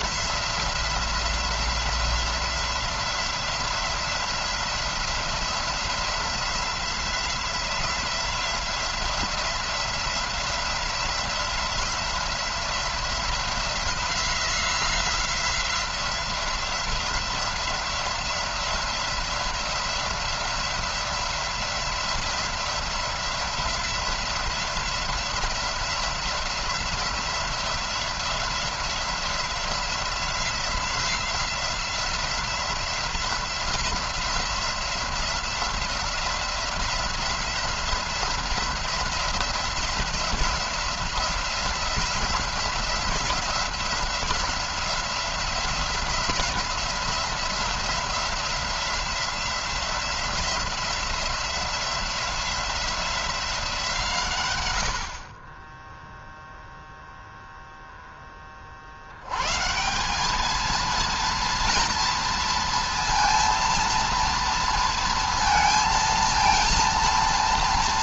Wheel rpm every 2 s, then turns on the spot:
170, 180, 170, 180, 180, 180, 170, 180, 180, 180, 180, 180, 180, 180, 180, 180, 180, 180, 180, 180, 180, 180, 180, 180, 180, 180, 180, 110, 0, 30, 210, 230, 230, 230.
none